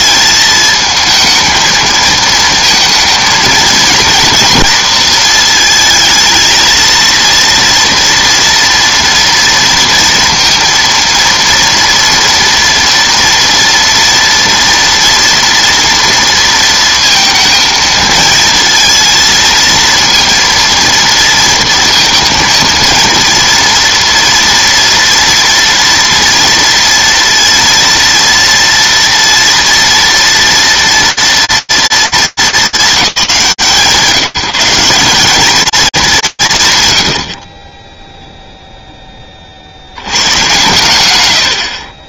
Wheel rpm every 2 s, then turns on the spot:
220, 220, 230, 220, 230, 230, 230, 230, 230, 230, 230, 230, 230, 230, 230, 230, 200, 180, 120, 10, 110.
none